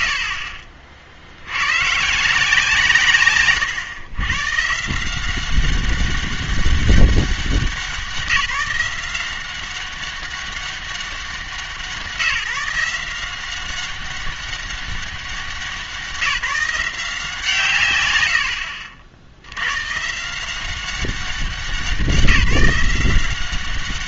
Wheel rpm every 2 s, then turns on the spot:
70, 160, 140, 200, 180, 190, 170, 200, 170, 70, 180, 180.
none